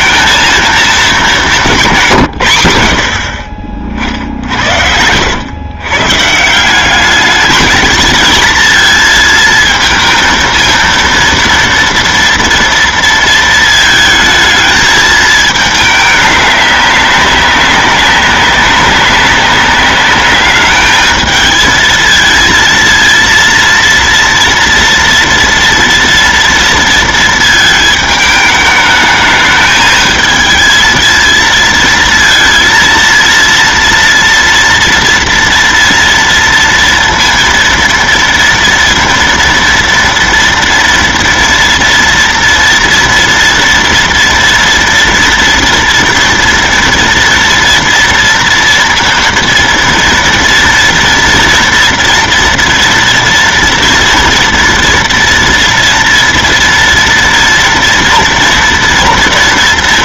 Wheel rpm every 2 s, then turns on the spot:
220, 110, 70, 160, 230, 230, 230, 220, 200, 190, 210, 230, 230, 230, 210, 220, 230, 230, 230, 230, 230, 230, 240, 230, 230, 230, 230, 230, 230, 230.
none